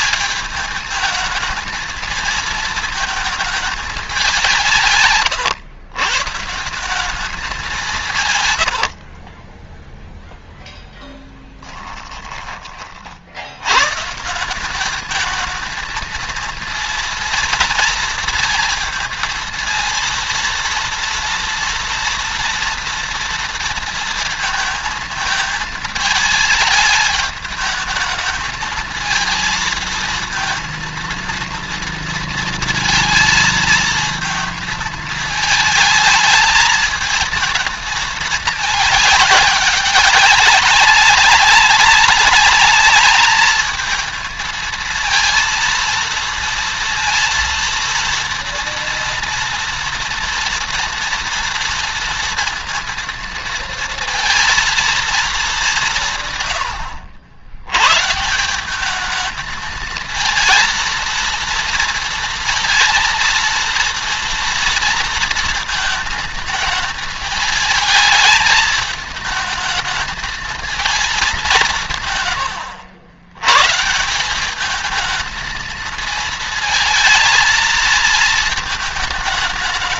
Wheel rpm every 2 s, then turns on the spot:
220, 220, 190, 140, 130, 0, 10, 160, 230, 230, 230, 230, 230, 220, 220, 230, 230, 220, 220, 220, 190, 200, 220, 230, 230, 230, 230, 230, 140, 150, 230, 230, 230, 220, 220, 220, 110, 190, 220, 220.
72-74